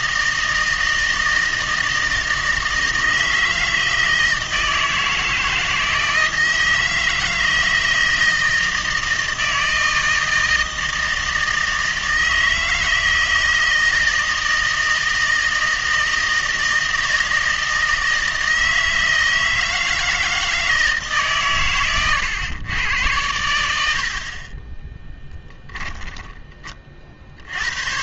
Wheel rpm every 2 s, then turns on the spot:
160, 160, 160, 160, 170, 160, 160, 160, 160, 160, 160, 110, 20, 30.
none